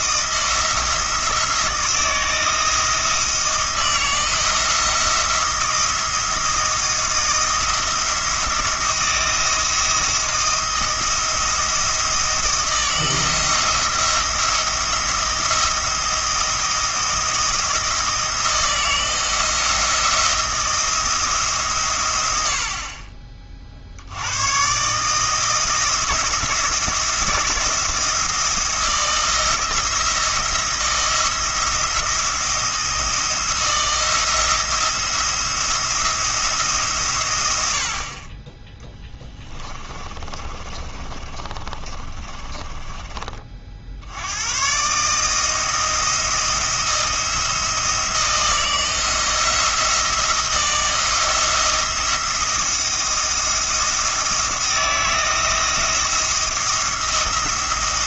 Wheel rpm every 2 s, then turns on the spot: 170, 160, 170, 170, 160, 170, 170, 170, 160, 160, 170, 40, 130, 170, 170, 170, 170, 170, 150, 10, 30, 30, 130, 170, 170, 160, 170, 170, 170.
40-44